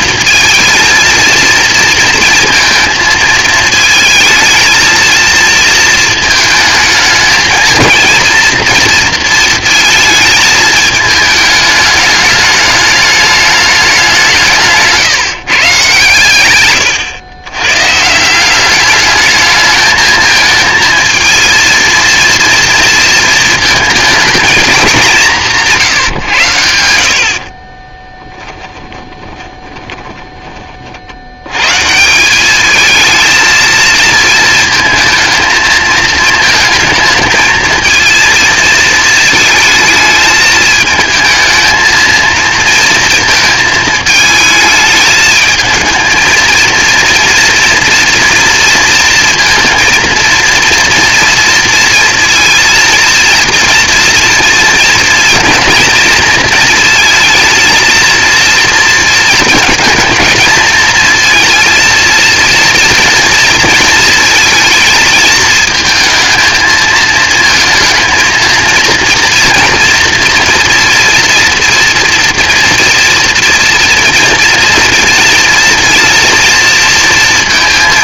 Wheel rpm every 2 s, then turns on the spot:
220, 230, 230, 220, 230, 220, 210, 160, 110, 200, 220, 230, 230, 110, 20, 30, 200, 220, 220, 230, 210, 230, 220, 230, 230, 230, 230, 230, 220, 230, 220, 230, 220, 220, 230, 230, 230, 230, 230.
28-30